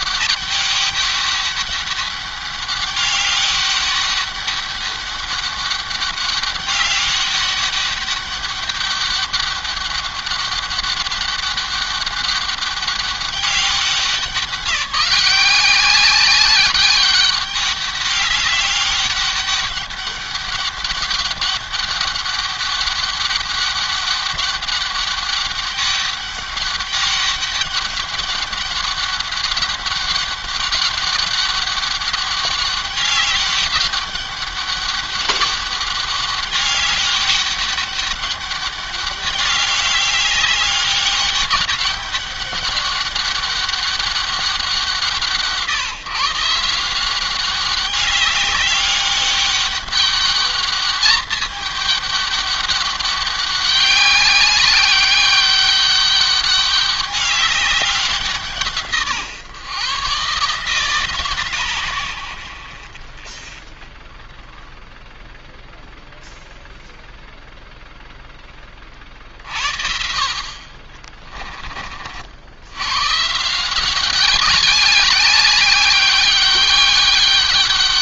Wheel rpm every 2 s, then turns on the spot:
200, 200, 200, 200, 200, 200, 200, 190, 200, 200, 200, 200, 200, 200, 200, 200, 200, 200, 200, 200, 200, 200, 150, 190, 200, 210, 200, 200, 200, 140, 130, 20, 0, 0, 50, 30, 160, 200, 200.
none